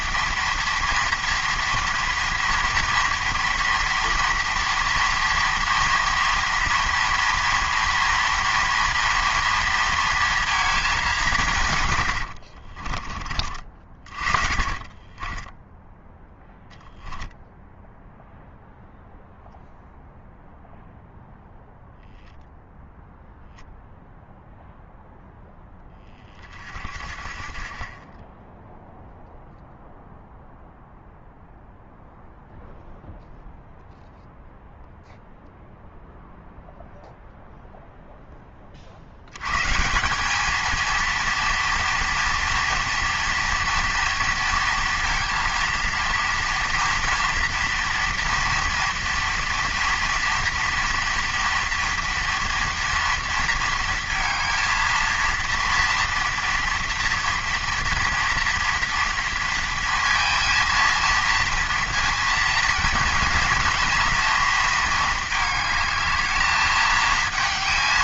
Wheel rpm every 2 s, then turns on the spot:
230, 230, 230, 230, 230, 220, 60, 30, 0, 0, 0, 0, 0, 40, 10, 0, 0, 0, 0, 30, 220, 230, 230, 230, 230, 230, 230, 230, 230, 240, 230, 230, 230, 220.
12-16